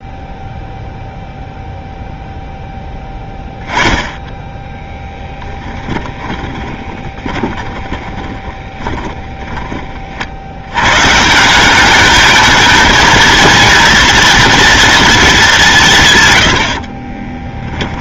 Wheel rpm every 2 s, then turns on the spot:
0, 0, 10, 20, 20, 90, 220, 230, 100.
6-10 16-18